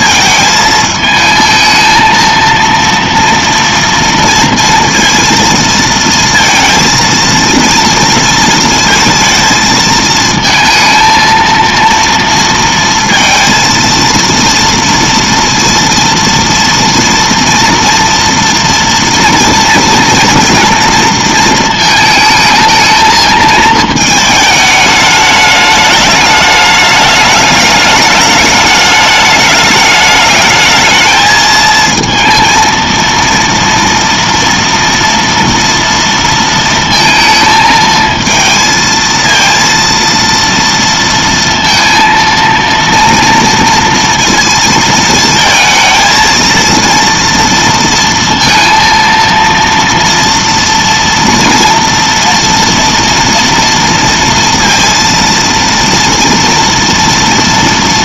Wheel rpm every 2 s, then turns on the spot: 220, 230, 230, 230, 230, 230, 230, 230, 230, 230, 230, 220, 210, 210, 210, 220, 230, 230, 230, 230, 230, 230, 230, 230, 230, 230, 230, 230, 230.
none